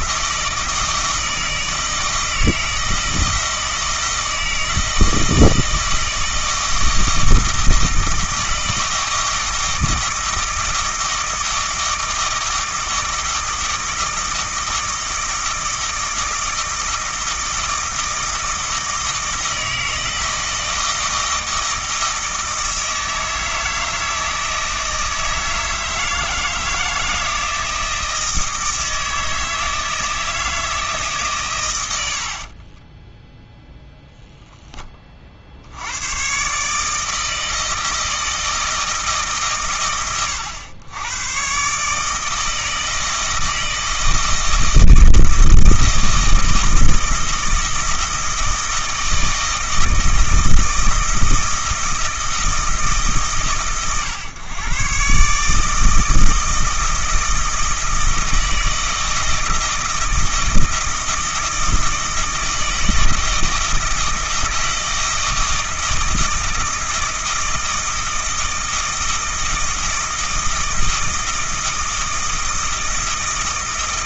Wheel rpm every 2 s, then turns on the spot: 160, 160, 160, 160, 160, 160, 160, 160, 160, 160, 160, 160, 160, 160, 160, 160, 20, 30, 150, 160, 100, 160, 160, 160, 160, 160, 150, 130, 160, 160, 160, 160, 160, 160, 160, 160, 160.
32-34